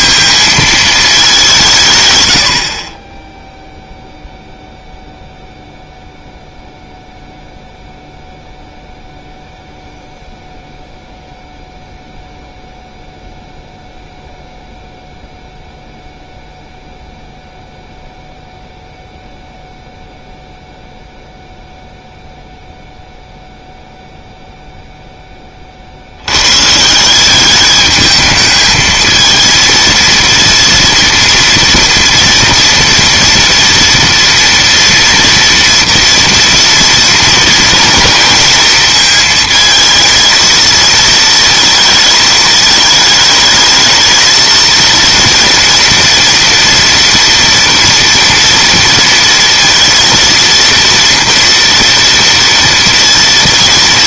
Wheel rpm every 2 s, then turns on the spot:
220, 50, 0, 0, 0, 0, 0, 0, 0, 0, 0, 0, 0, 140, 220, 230, 230, 230, 230, 230, 230, 220, 230, 230, 230, 230, 230.
none